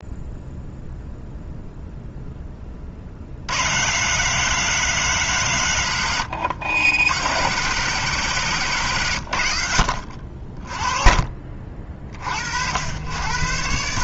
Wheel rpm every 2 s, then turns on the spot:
0, 30, 150, 100, 130, 30, 70.
none